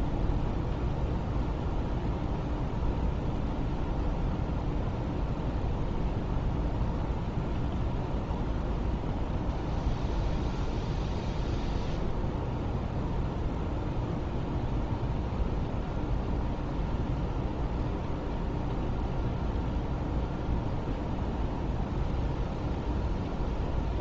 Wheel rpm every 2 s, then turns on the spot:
0, 0, 0, 0, 0, 0, 0, 0, 0, 0, 0, 0.
none